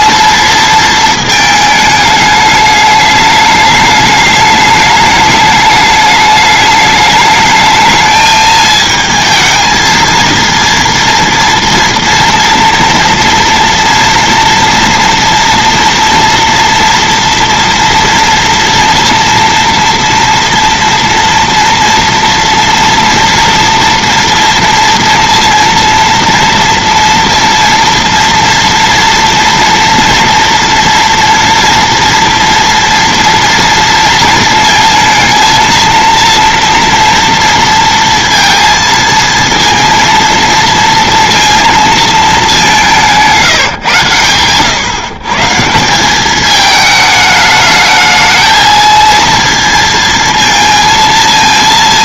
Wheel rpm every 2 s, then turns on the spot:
230, 210, 210, 210, 220, 230, 230, 230, 230, 240, 230, 230, 230, 230, 230, 230, 230, 230, 230, 230, 230, 210, 120, 210, 220, 230.
none